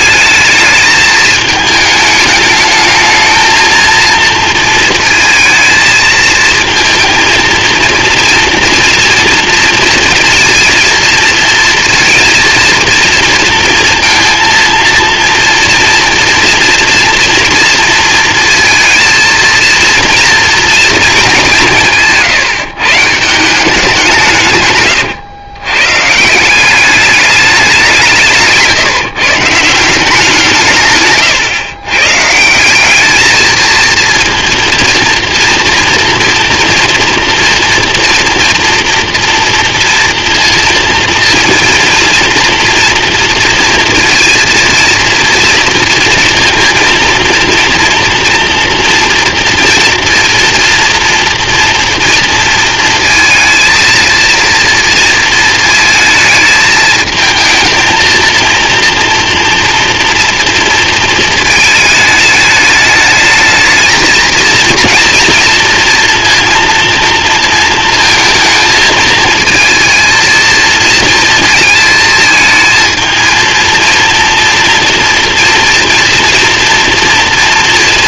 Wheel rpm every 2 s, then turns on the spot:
220, 210, 230, 230, 230, 230, 230, 230, 230, 230, 230, 150, 120, 190, 160, 150, 190, 230, 240, 240, 230, 230, 230, 230, 230, 230, 230, 230, 220, 230, 230, 210, 240, 240, 220, 230, 220, 230, 230.
24-26